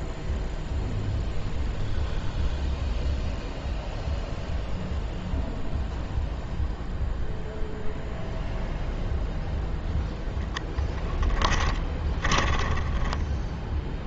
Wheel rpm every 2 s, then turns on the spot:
0, 0, 0, 0, 0, 10, 10.
12-14